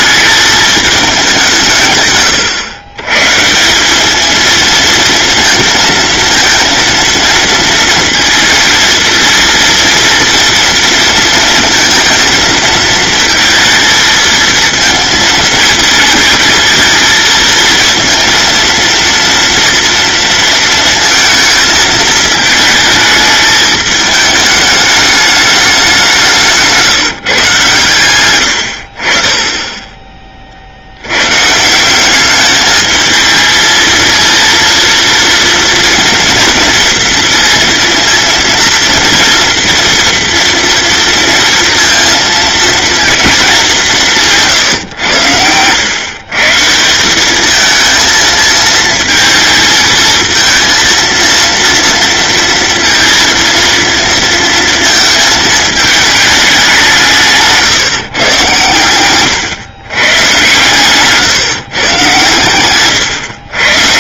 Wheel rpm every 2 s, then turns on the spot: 210, 110, 230, 230, 230, 230, 220, 220, 220, 230, 230, 220, 210, 150, 60, 80, 220, 230, 230, 230, 230, 230, 110, 180, 220, 230, 230, 220, 170, 120, 140, 120.
28-30